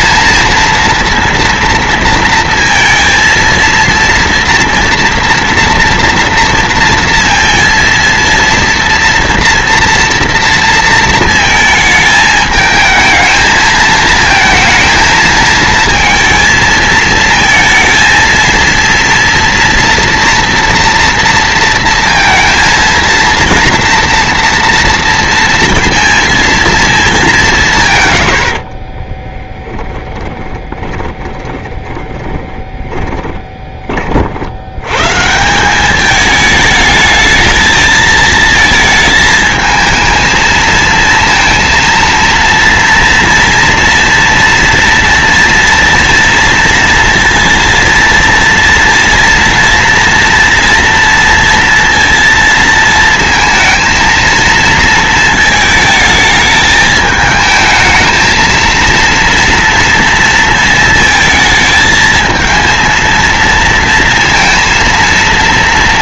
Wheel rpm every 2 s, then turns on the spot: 230, 230, 230, 230, 230, 230, 220, 230, 230, 230, 230, 230, 230, 230, 80, 20, 20, 70, 210, 220, 220, 230, 240, 230, 230, 230, 230, 230, 220, 230, 230, 220, 230.
28-34